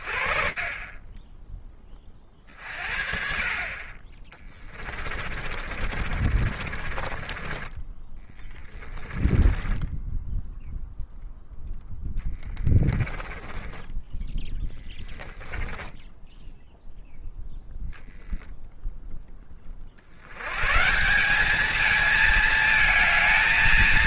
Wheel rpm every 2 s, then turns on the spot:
30, 50, 30, 40, 10, 0, 10, 20, 0, 20, 200, 220.
4-10 12-16